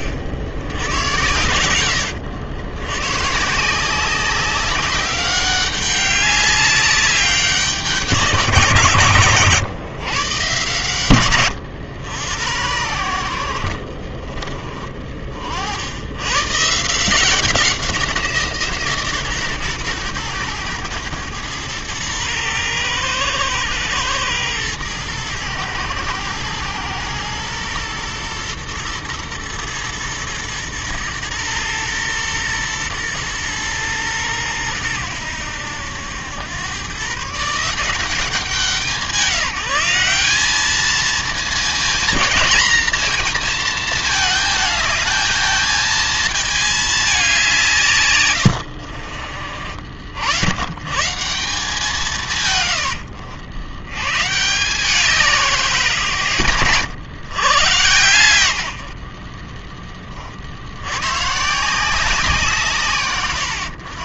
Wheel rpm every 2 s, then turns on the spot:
80, 100, 190, 200, 160, 110, 90, 30, 140, 160, 110, 110, 110, 110, 110, 110, 110, 100, 110, 190, 210, 230, 220, 220, 80, 110, 130, 160, 100, 80, 80, 150.
14-16 48-50 52-54